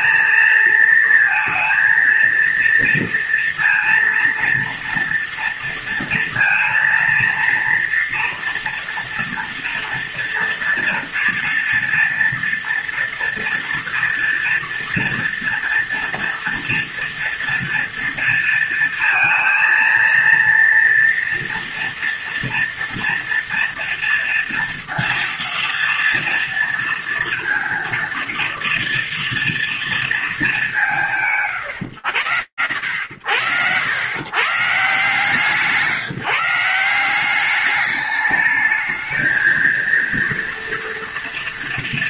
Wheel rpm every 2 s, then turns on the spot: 230, 230, 230, 230, 240, 230, 230, 230, 230, 230, 230, 230, 230, 230, 230, 210, 70, 150, 180, 220, 240.
none